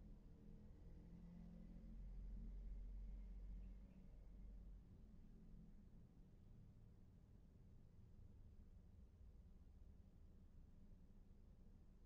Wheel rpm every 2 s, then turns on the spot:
0, 0, 0, 0, 0, 0.
none